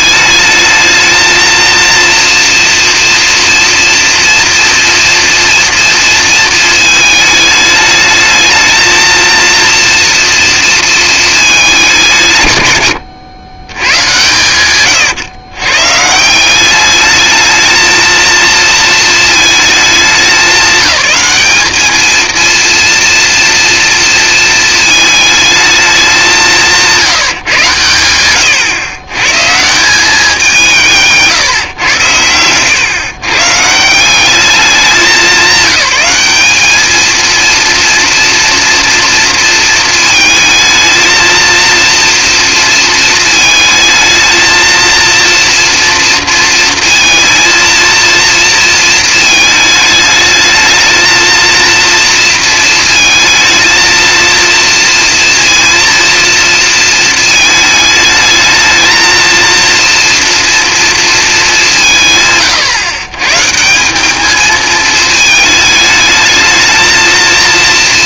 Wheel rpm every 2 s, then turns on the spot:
220, 230, 230, 220, 220, 230, 110, 110, 200, 230, 210, 230, 220, 170, 120, 180, 110, 200, 220, 240, 220, 220, 230, 230, 230, 220, 220, 230, 230, 220, 230, 120, 220, 220.
12-16